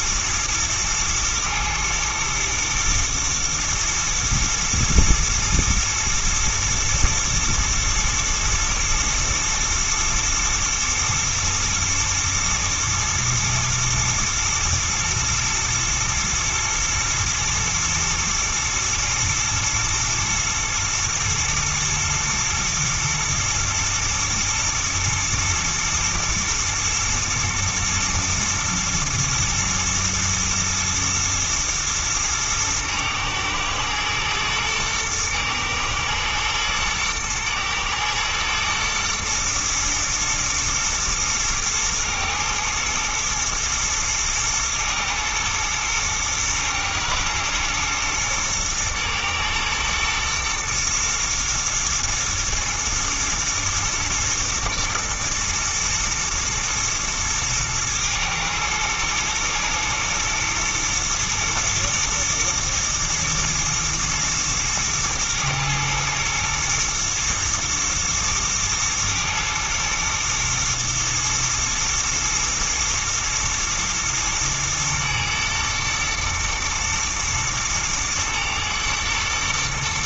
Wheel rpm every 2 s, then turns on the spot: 110, 110, 110, 110, 110, 110, 110, 110, 120, 120, 110, 110, 120, 110, 120, 110, 110, 110, 110, 120, 110, 120, 110, 110, 110, 120, 120, 110, 110, 110, 120, 120, 110, 120, 110, 120, 110, 110, 120, 110.
none